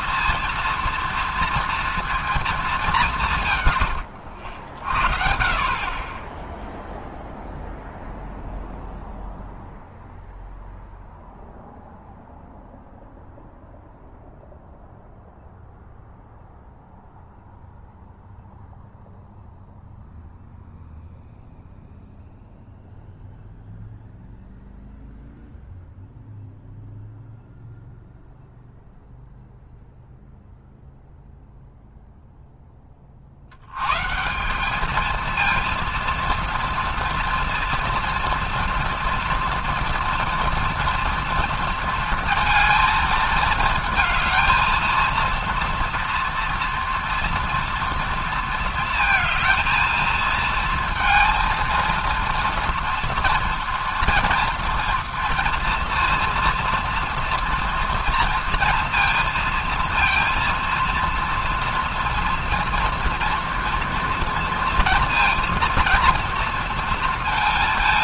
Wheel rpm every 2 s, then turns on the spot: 230, 210, 60, 0, 0, 0, 0, 0, 0, 0, 0, 0, 0, 0, 0, 0, 10, 200, 230, 230, 240, 230, 220, 240, 230, 230, 230, 230, 230, 230, 230, 230, 230, 230.
none